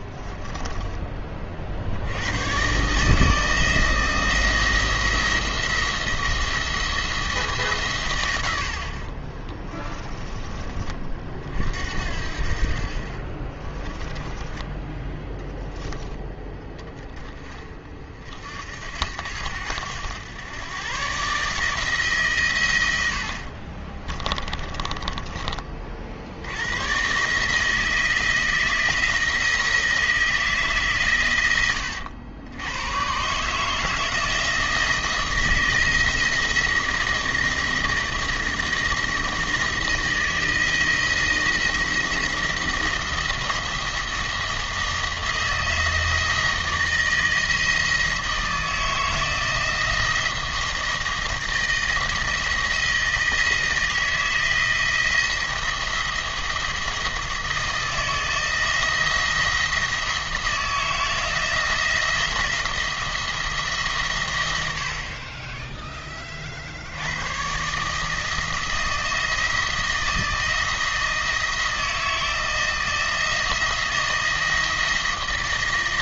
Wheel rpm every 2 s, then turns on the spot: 10, 130, 170, 170, 70, 20, 50, 10, 20, 70, 110, 110, 30, 90, 170, 160, 100, 160, 170, 170, 160, 170, 170, 170, 160, 170, 160, 160, 170, 170, 160, 170, 90, 60, 160, 160, 160, 160.
0-2 14-16 24-26